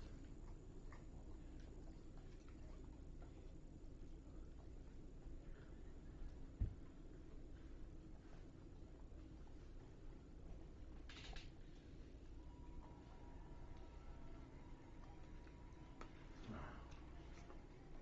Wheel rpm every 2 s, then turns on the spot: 0, 0, 0, 0, 0, 0, 0, 0, 0.
none